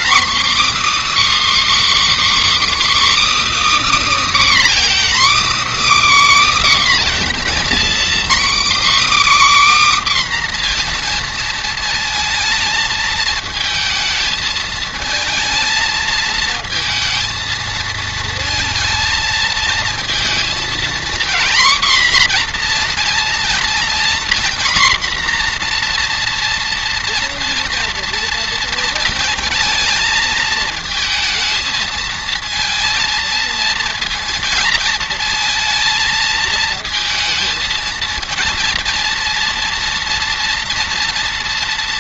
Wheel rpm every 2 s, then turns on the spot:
280, 310, 300, 290, 270, 260, 220, 220, 230, 220, 230, 240, 240, 240, 230, 220, 220, 230, 220, 230, 230.
none